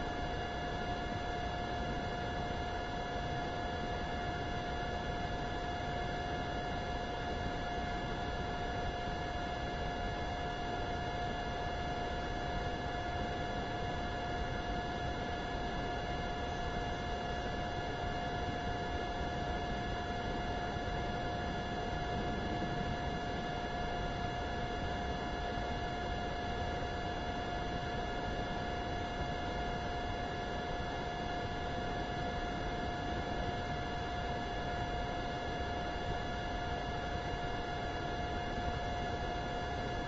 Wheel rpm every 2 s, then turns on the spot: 0, 0, 0, 0, 0, 0, 0, 0, 0, 0, 0, 0, 0, 0, 0, 0, 0, 0, 0, 0.
none